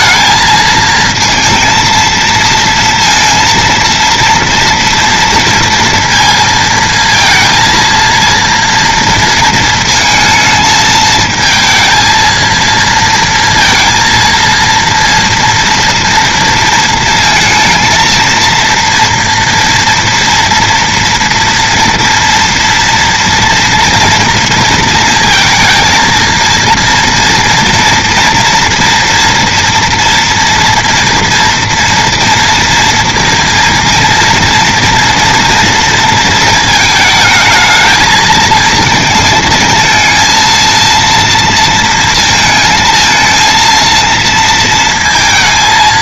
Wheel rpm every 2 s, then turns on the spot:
220, 230, 230, 230, 230, 220, 230, 230, 230, 230, 230, 230, 230, 230, 240, 230, 230, 230, 220, 220, 230, 220, 230.
none